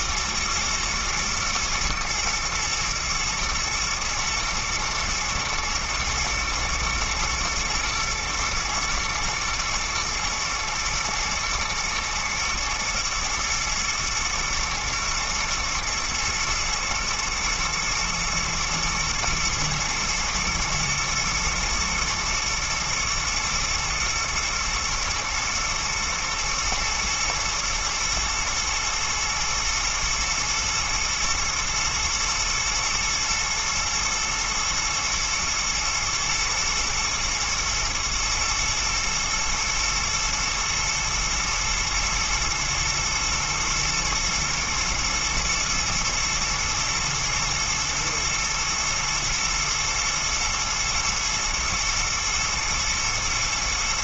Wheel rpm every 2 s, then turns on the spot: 110, 120, 110, 110, 110, 110, 110, 110, 120, 120, 110, 110, 110, 120, 110, 110, 110, 120, 110, 110, 110, 110, 110, 110, 110, 110, 110.
none